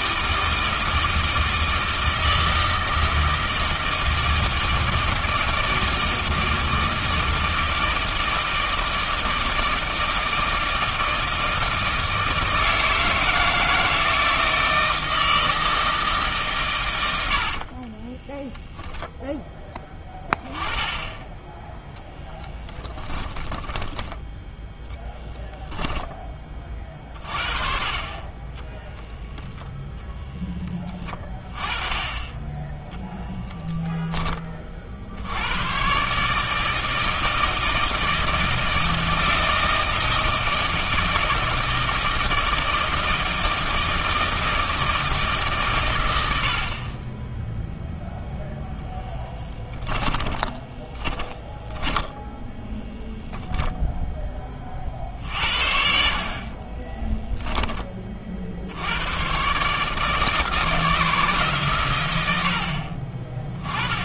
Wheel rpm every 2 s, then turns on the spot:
160, 160, 160, 160, 160, 160, 160, 160, 120, 0, 10, 10, 10, 30, 10, 20, 10, 50, 160, 160, 160, 160, 160, 40, 0, 10, 0, 40, 30, 80, 160, 60.
22-24 50-52 56-58